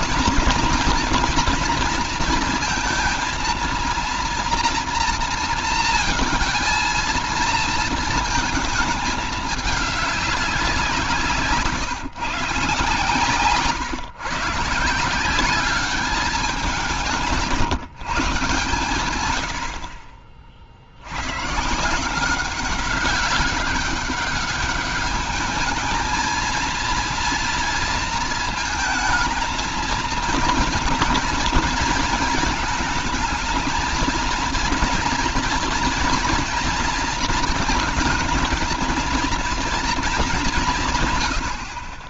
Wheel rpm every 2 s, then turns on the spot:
230, 230, 240, 230, 220, 200, 150, 140, 200, 140, 40, 180, 200, 230, 230, 230, 220, 240, 240, 220, 200.
none